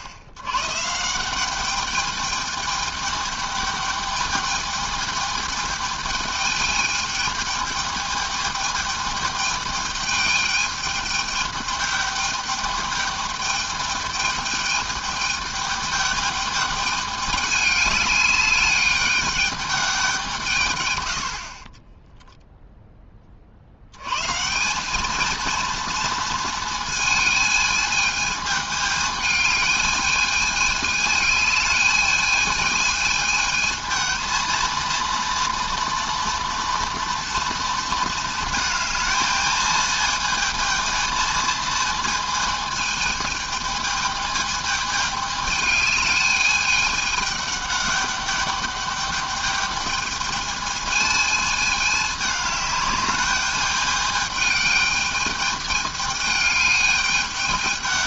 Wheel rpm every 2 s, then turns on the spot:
110, 210, 210, 210, 210, 210, 210, 210, 210, 210, 140, 0, 170, 230, 220, 210, 220, 230, 230, 220, 230, 220, 220, 210, 200, 220, 200, 220, 210.
none